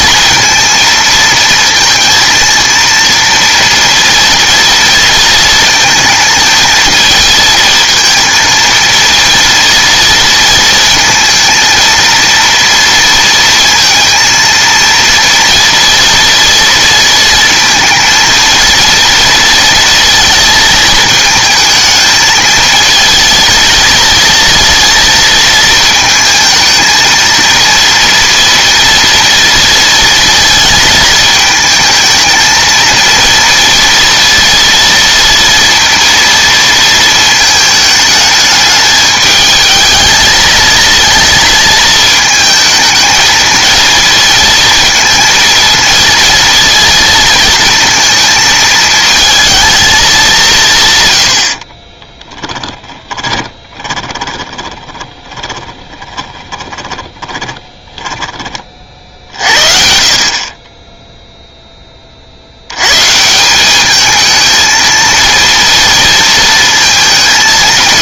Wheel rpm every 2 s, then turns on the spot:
230, 230, 230, 230, 230, 230, 230, 230, 230, 230, 220, 220, 230, 220, 240, 230, 230, 230, 230, 210, 220, 220, 220, 230, 220, 160, 10, 20, 20, 40, 20, 90, 230, 230.
52-58